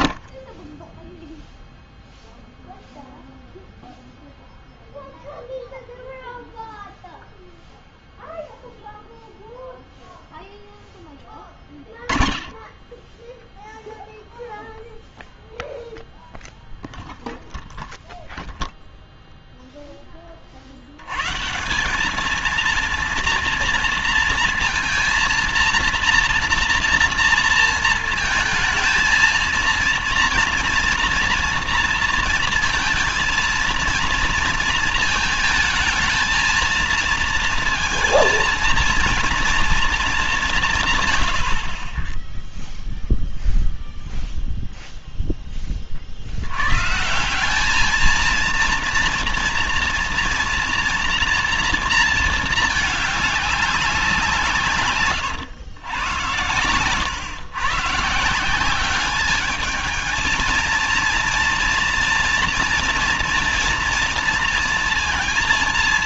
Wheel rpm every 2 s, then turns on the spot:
50, 0, 0, 0, 0, 0, 20, 0, 0, 0, 50, 220, 240, 240, 220, 230, 230, 230, 230, 230, 170, 0, 0, 110, 230, 230, 220, 160, 110, 180, 230, 230, 230.
none